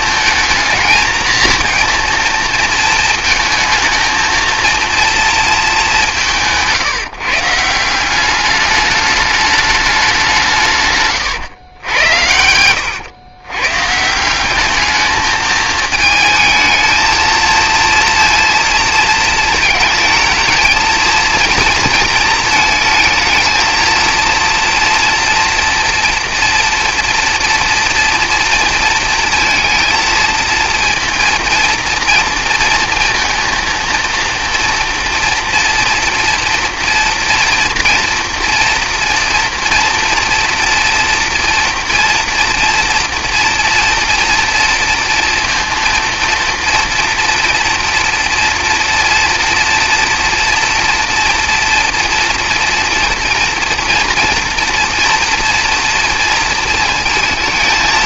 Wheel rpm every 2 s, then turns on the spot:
220, 220, 230, 150, 210, 150, 100, 210, 220, 230, 220, 220, 230, 230, 230, 230, 230, 230, 230, 230, 230, 230, 230, 230, 240, 230, 230, 230, 230.
none